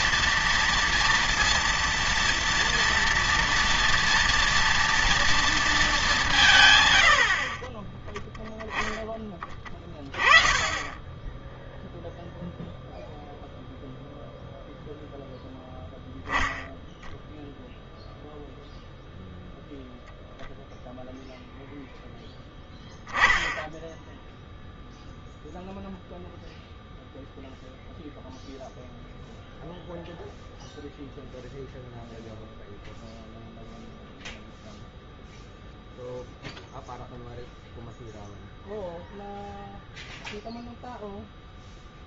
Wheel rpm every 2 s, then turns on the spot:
230, 230, 230, 100, 20, 20, 0, 0, 0, 0, 0, 10, 0, 0, 0, 0, 0, 0, 0, 0, 0.
none